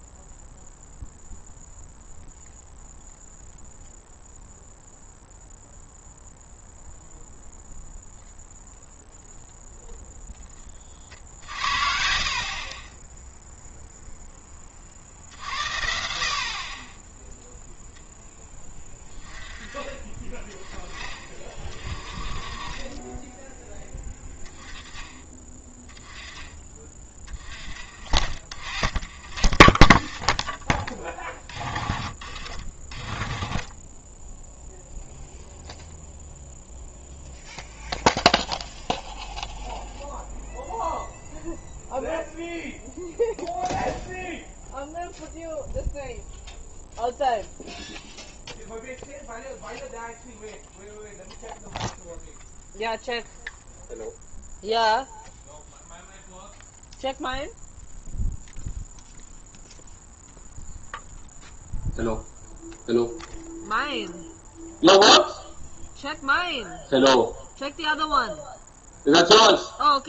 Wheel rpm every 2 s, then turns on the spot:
0, 0, 0, 0, 0, 20, 30, 40, 30, 10, 20, 30, 10, 20, 10, 20, 40, 0, 0, 0, 0, 0, 0, 0, 0, 0, 0, 0, 0, 0, 0, 0, 0, 0, 0.
none